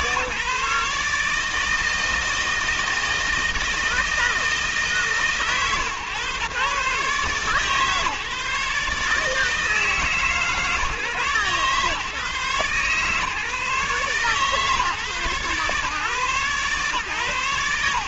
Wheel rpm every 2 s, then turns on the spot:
140, 160, 160, 130, 140, 150, 130, 140, 130.
none